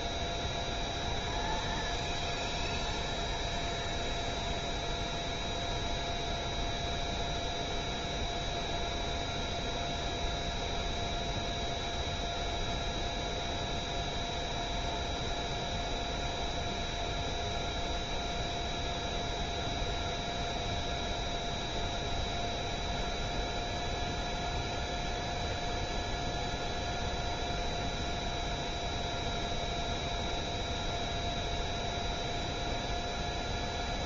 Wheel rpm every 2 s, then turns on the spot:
0, 0, 0, 0, 0, 0, 0, 0, 0, 0, 0, 0, 0, 0, 0, 0, 0.
none